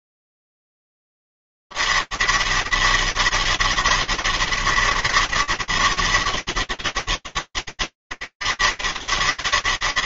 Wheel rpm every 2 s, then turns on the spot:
110, 200, 170, 190, 200.
none